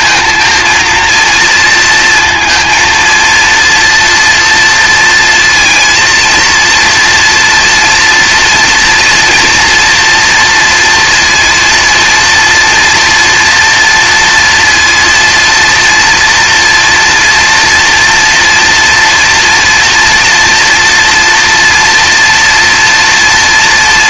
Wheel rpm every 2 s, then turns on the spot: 230, 230, 230, 230, 240, 230, 230, 230, 230, 230, 230, 230.
none